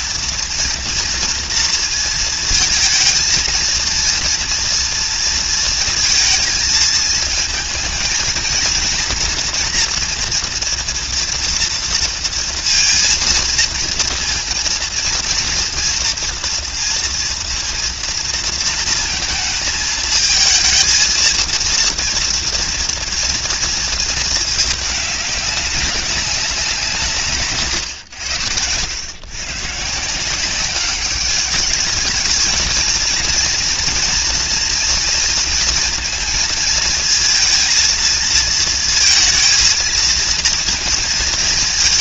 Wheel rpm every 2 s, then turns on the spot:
230, 230, 230, 230, 230, 230, 230, 230, 240, 230, 220, 240, 220, 180, 90, 190, 220, 230, 230, 230, 230.
none